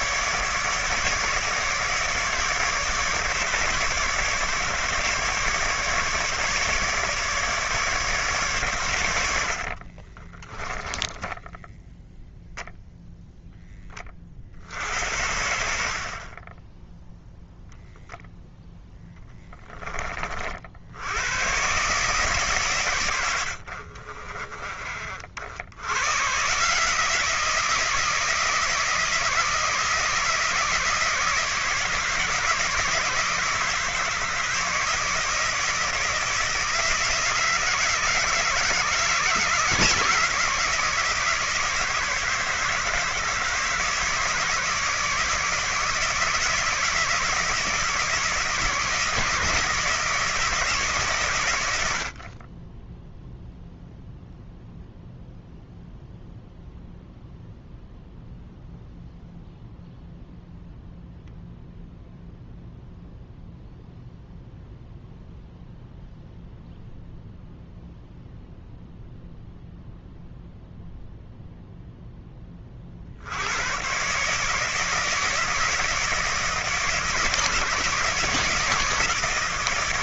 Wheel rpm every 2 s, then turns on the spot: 150, 150, 140, 150, 120, 10, 0, 50, 10, 0, 60, 120, 30, 150, 160, 160, 160, 160, 160, 160, 160, 150, 160, 160, 160, 140, 10, 0, 0, 0, 0, 0, 0, 0, 0, 0, 40, 160, 160, 160.
10-12